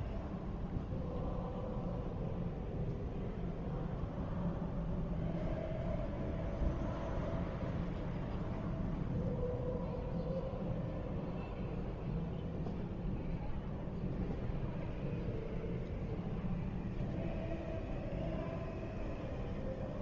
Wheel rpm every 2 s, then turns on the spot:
0, 0, 0, 0, 0, 0, 0, 0, 0, 0.
none